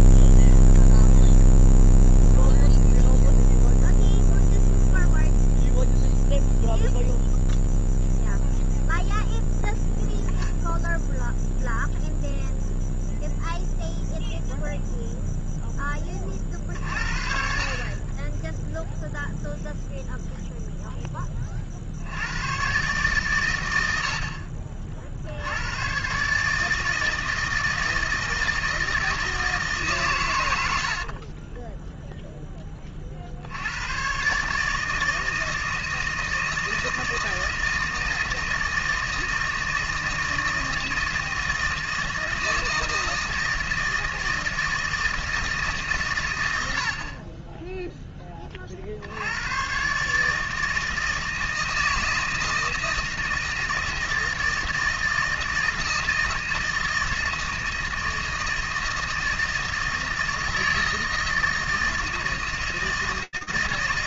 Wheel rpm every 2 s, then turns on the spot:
0, 0, 0, 0, 0, 10, 0, 0, 40, 10, 0, 110, 50, 150, 160, 90, 10, 150, 160, 160, 160, 160, 160, 100, 20, 150, 160, 160, 160, 160, 160, 160.
30-32